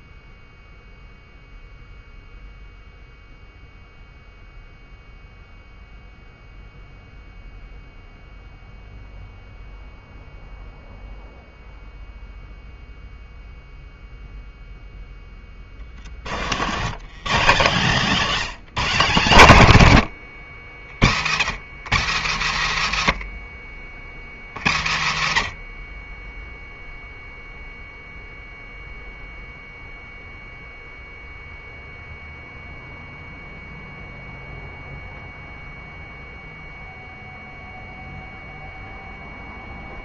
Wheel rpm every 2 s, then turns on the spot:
0, 0, 0, 0, 0, 0, 0, 0, 110, 190, 70, 80, 60, 0, 0, 0, 0, 0, 0, 0.
none